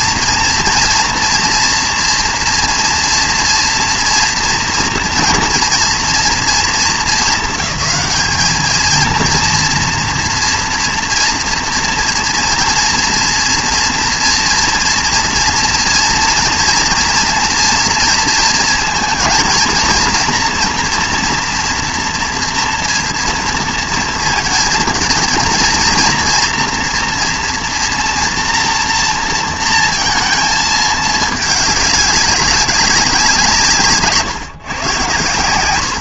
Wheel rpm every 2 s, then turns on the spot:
230, 240, 230, 220, 220, 230, 230, 240, 230, 230, 230, 230, 220, 230, 230, 220, 190, 130.
none